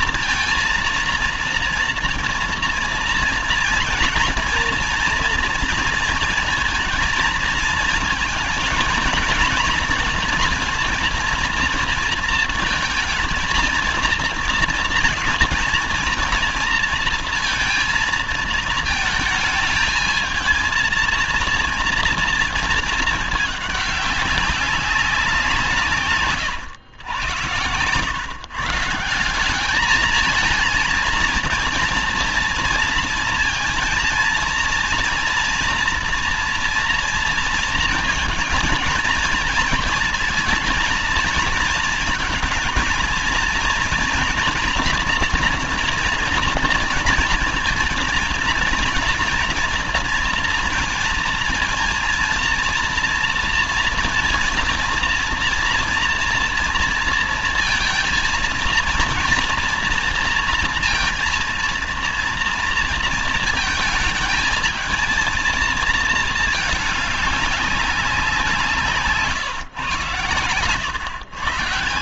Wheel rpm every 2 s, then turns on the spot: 230, 230, 230, 230, 230, 230, 230, 230, 230, 220, 220, 230, 190, 140, 150, 230, 230, 230, 230, 230, 230, 230, 240, 230, 230, 230, 230, 230, 230, 230, 230, 230, 220, 220, 180, 110.
none